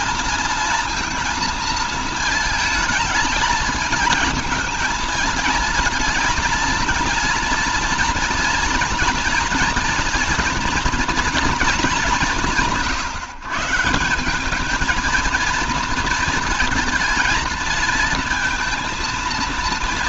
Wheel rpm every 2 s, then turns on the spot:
230, 220, 220, 230, 230, 240, 180, 200, 220, 230.
none